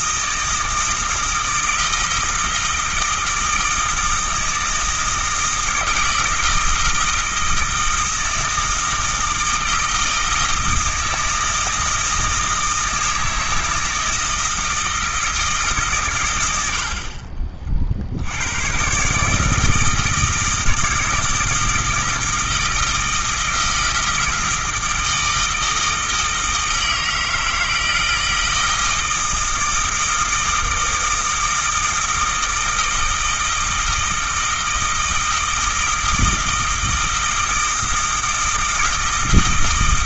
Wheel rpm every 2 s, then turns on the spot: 160, 160, 160, 160, 160, 160, 160, 160, 60, 130, 160, 160, 160, 160, 160, 160, 160, 160, 160, 160.
none